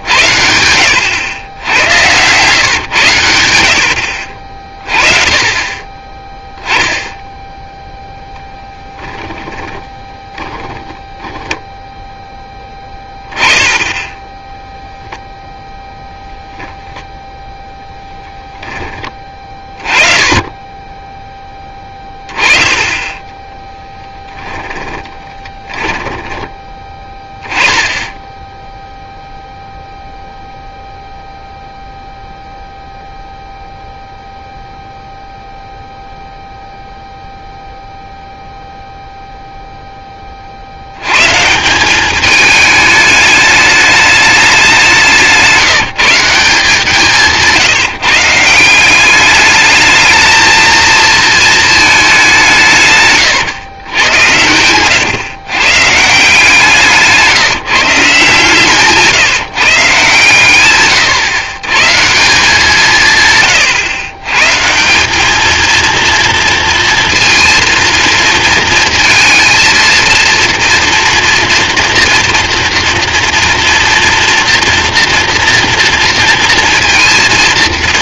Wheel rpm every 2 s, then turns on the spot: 80, 110, 50, 10, 10, 10, 10, 10, 0, 10, 20, 20, 10, 10, 10, 0, 0, 0, 0, 0, 40, 210, 190, 170, 170, 220, 160, 100, 160, 150, 120, 180, 140, 230, 230, 230, 240, 230, 230.
8-10 24-26 54-56